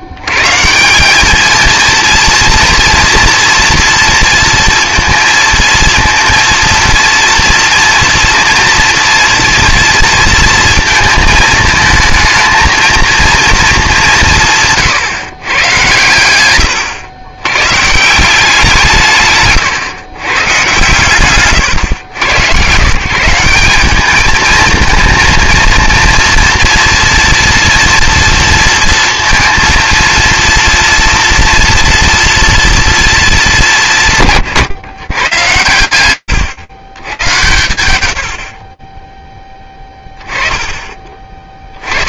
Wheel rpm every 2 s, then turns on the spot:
150, 230, 230, 230, 230, 230, 230, 160, 100, 170, 140, 120, 220, 230, 230, 230, 230, 130, 120, 20, 20.
none